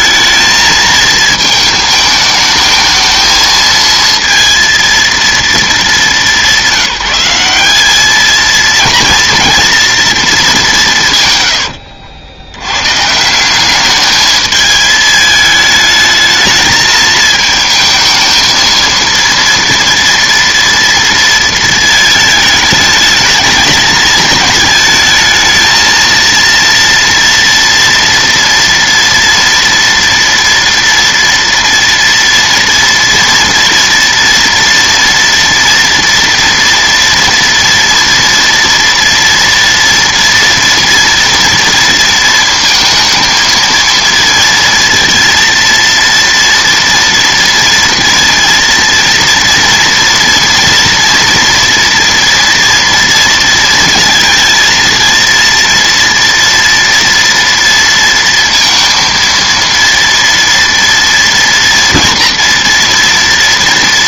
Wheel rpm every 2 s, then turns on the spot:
220, 220, 230, 190, 230, 190, 100, 220, 220, 230, 230, 220, 220, 230, 230, 230, 230, 230, 230, 230, 230, 230, 230, 230, 230, 230, 230, 230, 230, 230, 230, 230.
none